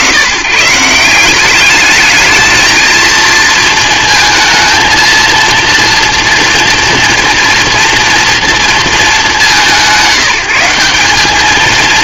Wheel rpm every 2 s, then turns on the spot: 150, 230, 230, 230, 200, 190.
none